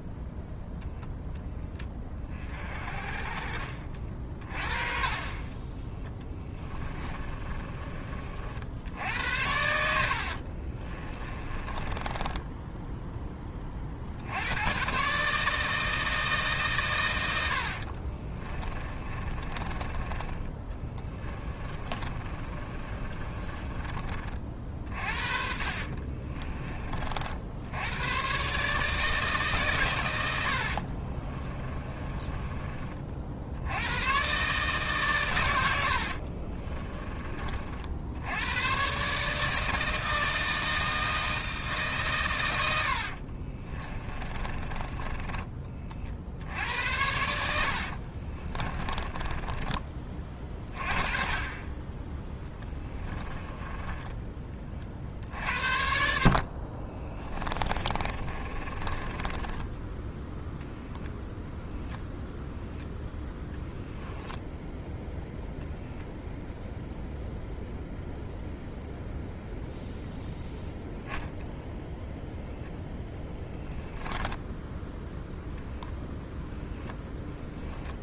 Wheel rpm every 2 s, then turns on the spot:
10, 40, 40, 20, 70, 30, 10, 120, 120, 30, 20, 30, 40, 30, 150, 60, 30, 140, 20, 130, 160, 90, 20, 80, 20, 30, 10, 40, 40, 20, 10, 0, 0, 0, 0, 0, 0, 0, 0.
4-8 10-14 18-26 30-32 36-38 44-46 48-50 52-54 56-60